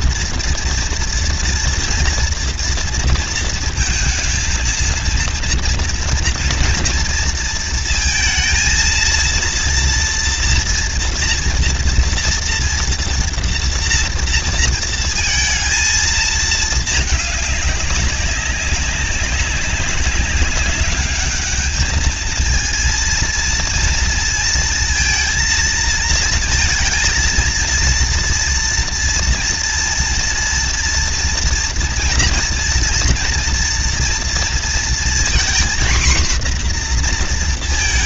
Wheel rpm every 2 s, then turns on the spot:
230, 230, 230, 230, 230, 230, 230, 230, 220, 200, 200, 220, 230, 220, 230, 230, 230, 230, 250.
none